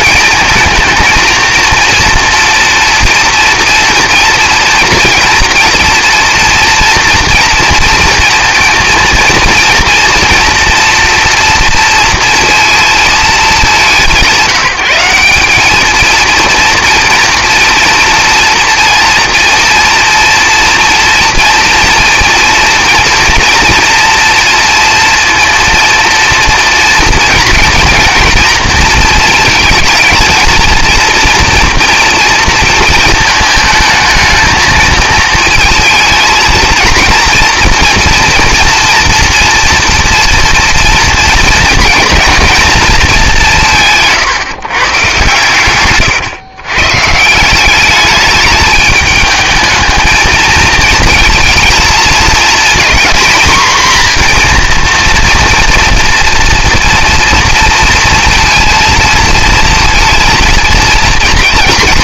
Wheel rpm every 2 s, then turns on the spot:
230, 230, 230, 240, 230, 230, 230, 190, 230, 230, 230, 230, 240, 230, 230, 230, 230, 220, 220, 230, 230, 220, 140, 120, 210, 220, 230, 230, 240, 230, 230.
none